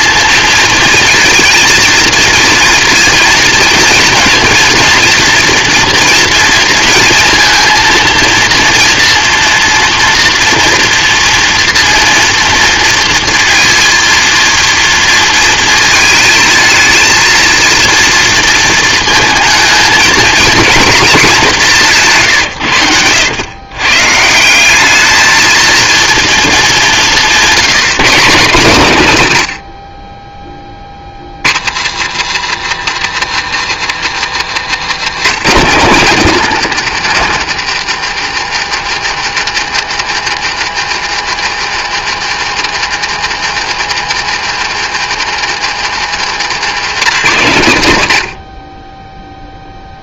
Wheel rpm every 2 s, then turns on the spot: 230, 230, 230, 230, 230, 240, 230, 230, 220, 230, 230, 140, 180, 210, 160, 20, 170, 170, 220, 180, 180, 180, 180, 170, 50.
22-24 34-36 46-48